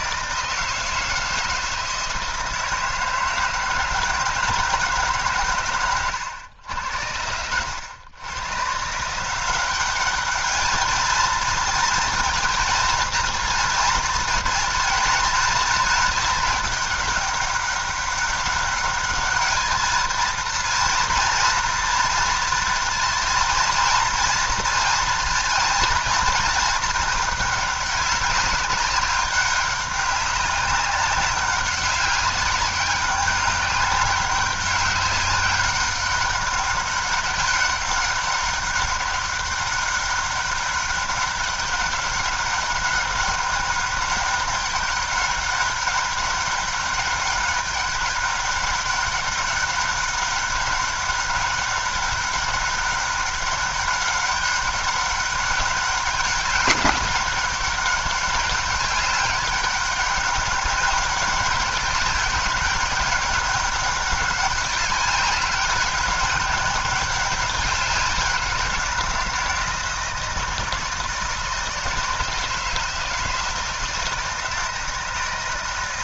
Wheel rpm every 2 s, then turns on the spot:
160, 160, 160, 90, 130, 210, 230, 230, 210, 200, 230, 230, 230, 220, 200, 190, 200, 200, 200, 200, 200, 200, 200, 200, 190, 200, 200, 200, 200, 200, 200, 190, 200, 190, 180, 160, 160, 160.
none